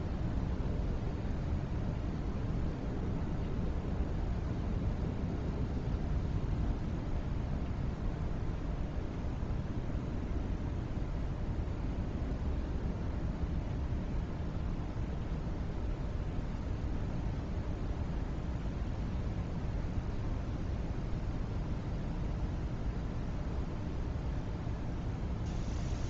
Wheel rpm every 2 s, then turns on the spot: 0, 0, 0, 0, 0, 0, 0, 0, 0, 0, 0, 0, 0.
none